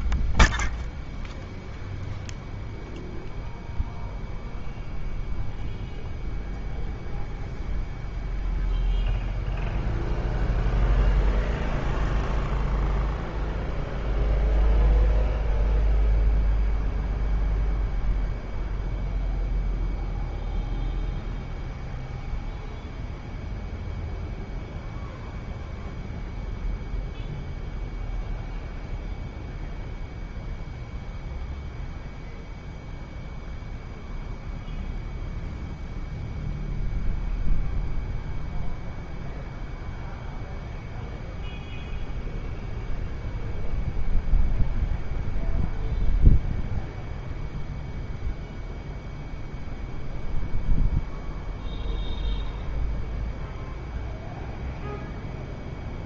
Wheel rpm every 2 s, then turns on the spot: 0, 0, 0, 0, 0, 0, 0, 0, 0, 0, 0, 0, 0, 0, 0, 0, 0, 0, 0, 0, 0, 0, 0, 0, 0, 0, 0, 0.
none